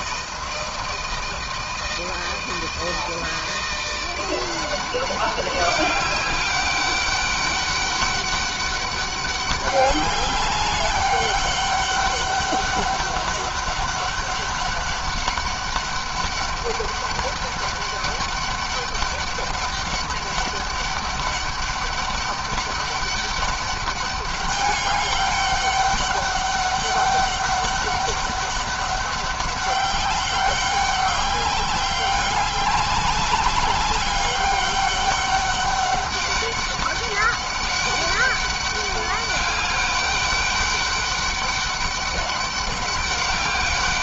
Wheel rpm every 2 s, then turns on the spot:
160, 160, 180, 190, 200, 200, 200, 200, 200, 200, 200, 200, 200, 200, 200, 200, 190, 200, 200, 200, 200, 200.
none